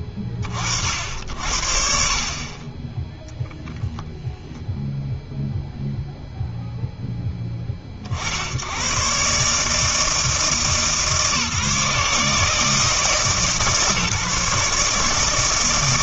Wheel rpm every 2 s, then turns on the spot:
60, 40, 0, 0, 100, 160, 160, 150.
none